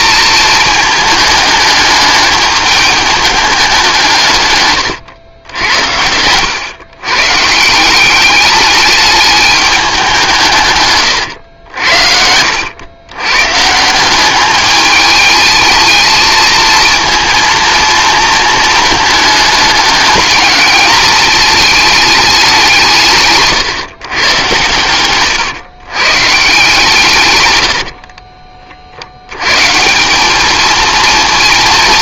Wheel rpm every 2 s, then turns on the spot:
220, 210, 130, 110, 210, 160, 90, 200, 230, 220, 210, 190, 110, 160, 40, 220.
4-6